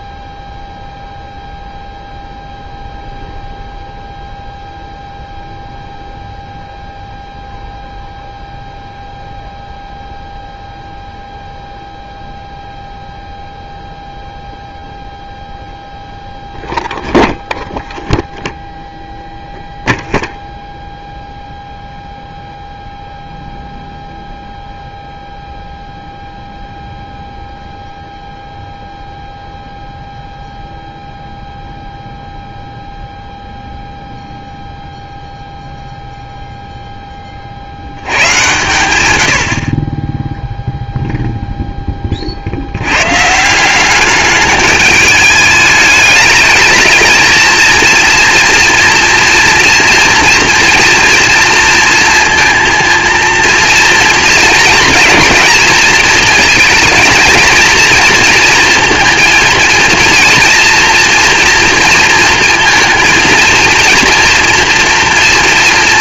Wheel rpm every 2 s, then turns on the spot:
0, 0, 0, 0, 0, 0, 0, 0, 0, 0, 0, 0, 0, 0, 0, 0, 0, 0, 0, 120, 0, 70, 210, 210, 230, 240, 230, 230, 230, 230, 230, 230, 240.
none